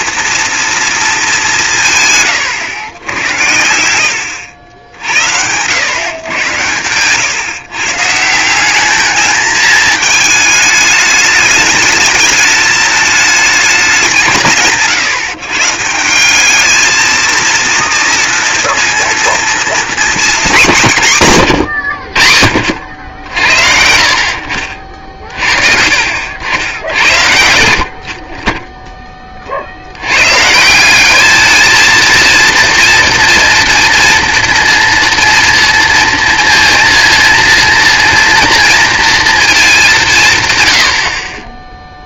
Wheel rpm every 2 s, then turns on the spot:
230, 110, 80, 120, 190, 220, 220, 150, 200, 230, 210, 70, 60, 70, 10, 160, 230, 230, 230, 240, 200.
none